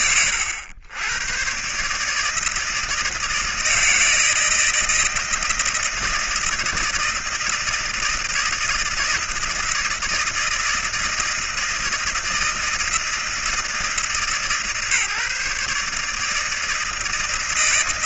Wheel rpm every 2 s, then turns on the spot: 100, 160, 160, 160, 160, 160, 160, 150, 160.
none